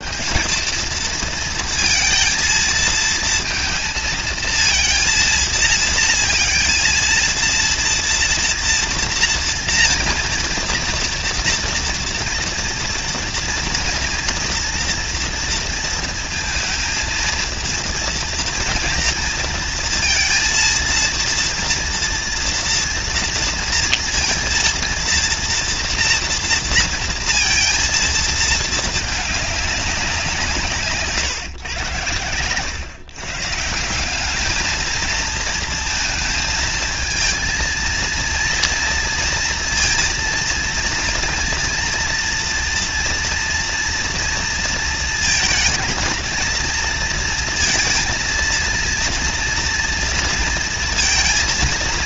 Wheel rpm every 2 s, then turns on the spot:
210, 230, 230, 230, 230, 230, 230, 230, 230, 230, 230, 230, 230, 230, 230, 170, 110, 210, 220, 230, 230, 230, 230, 230, 230, 230.
none